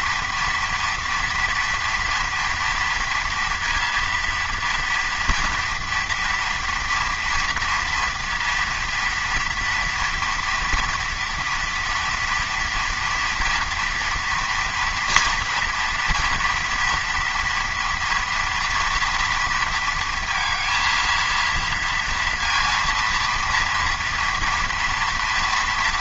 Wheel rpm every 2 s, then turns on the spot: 230, 230, 230, 240, 230, 230, 230, 230, 230, 230, 230, 230, 230.
none